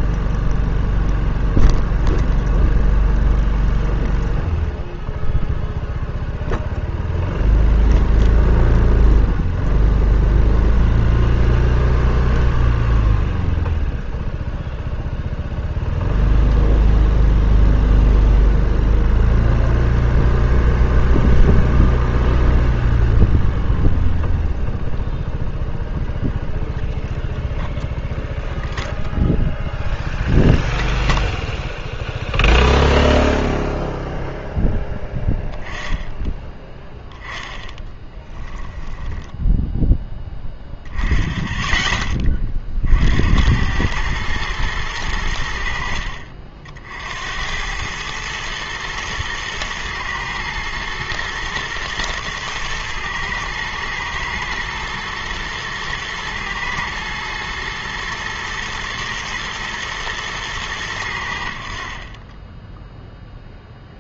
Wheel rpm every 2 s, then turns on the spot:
0, 0, 0, 0, 0, 0, 0, 0, 0, 0, 0, 0, 0, 0, 0, 0, 0, 10, 10, 10, 10, 40, 110, 50, 110, 110, 110, 110, 110, 110, 100, 10.
38-40